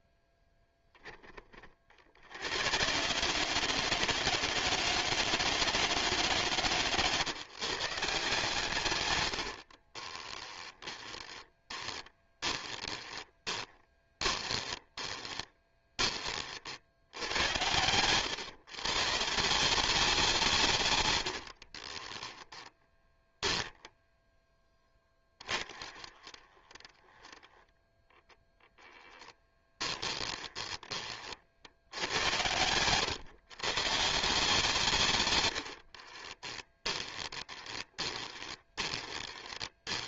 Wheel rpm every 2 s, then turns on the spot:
10, 90, 130, 110, 140, 10, 20, 20, 60, 130, 150, 20, 10, 10, 10, 20, 110, 160, 20, 20.
10-16 22-24 30-34 36-40